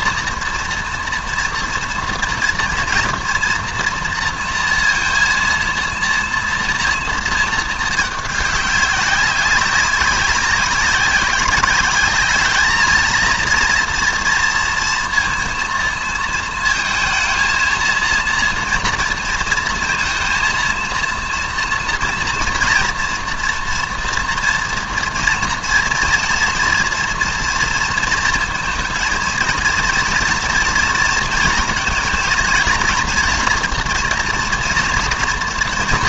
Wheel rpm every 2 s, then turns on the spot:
240, 230, 230, 230, 210, 190, 220, 230, 220, 230, 230, 230, 230, 230, 230, 230, 230, 240.
none